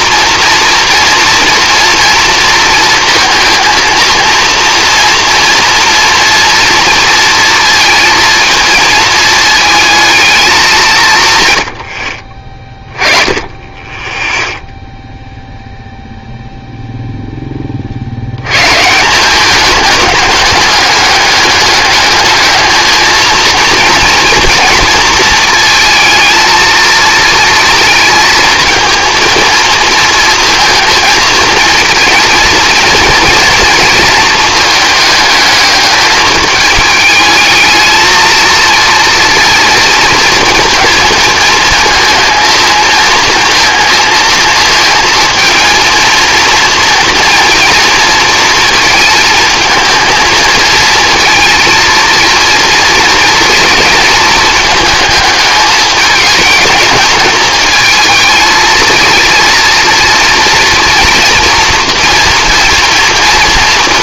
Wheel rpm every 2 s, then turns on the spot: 230, 230, 230, 230, 230, 200, 20, 0, 0, 130, 210, 220, 230, 230, 230, 230, 230, 220, 210, 230, 230, 220, 230, 230, 230, 220, 230, 220, 220, 230, 230, 230.
none